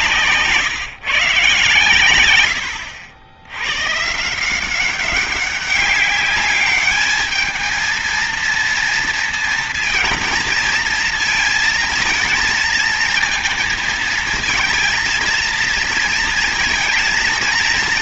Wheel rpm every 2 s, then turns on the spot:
130, 90, 190, 220, 230, 230, 230, 230, 240.
none